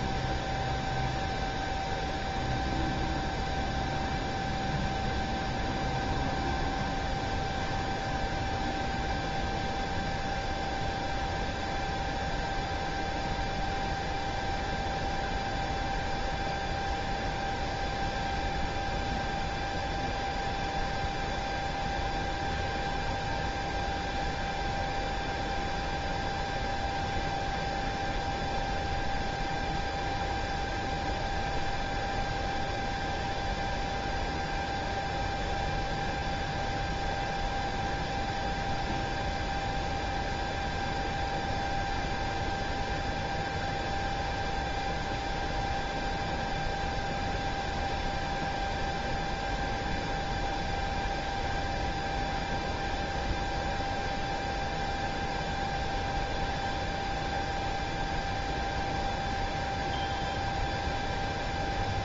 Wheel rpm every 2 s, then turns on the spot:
0, 0, 0, 0, 0, 0, 0, 0, 0, 0, 0, 0, 0, 0, 0, 0, 0, 0, 0, 0, 0, 0, 0, 0, 0, 0, 0, 0, 0, 0, 0.
none